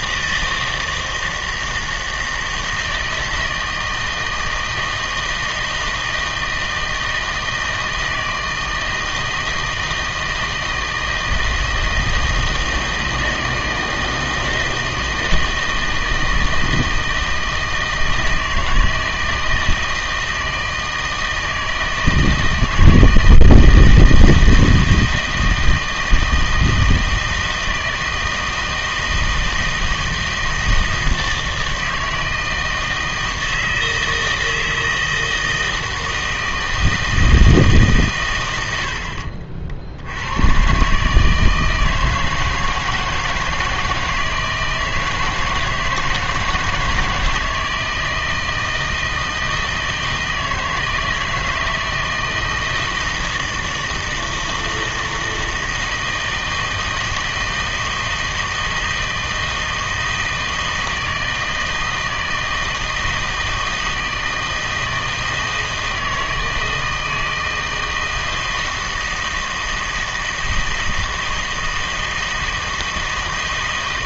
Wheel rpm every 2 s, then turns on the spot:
160, 160, 160, 160, 160, 160, 160, 160, 160, 160, 160, 160, 160, 160, 160, 160, 160, 160, 160, 80, 130, 160, 160, 160, 160, 160, 160, 160, 160, 160, 160, 160, 160, 160, 160, 160, 160.
none